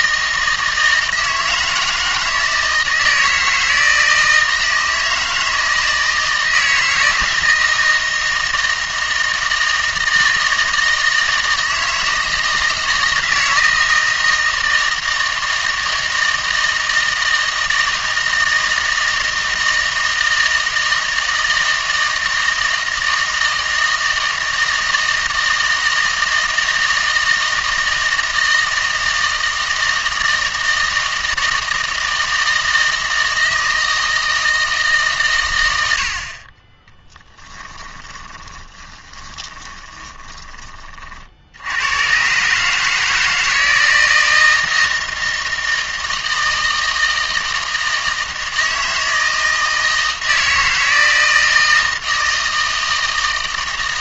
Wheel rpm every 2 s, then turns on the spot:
160, 160, 160, 160, 160, 160, 160, 160, 160, 160, 160, 160, 160, 160, 160, 160, 160, 160, 30, 20, 20, 140, 160, 160, 160, 160, 160.
38-40